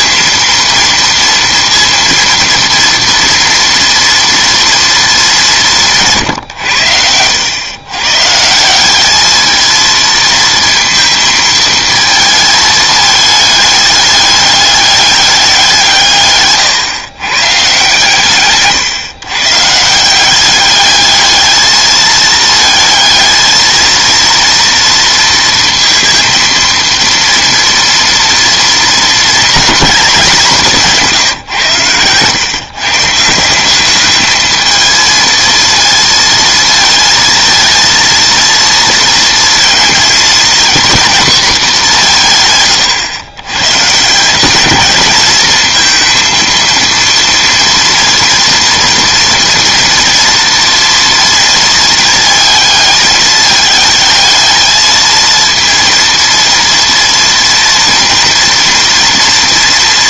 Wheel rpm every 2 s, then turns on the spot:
230, 230, 230, 110, 170, 230, 220, 210, 130, 140, 200, 220, 230, 230, 230, 190, 140, 220, 230, 230, 240, 140, 200, 230, 240, 230, 220, 220, 230, 230.
none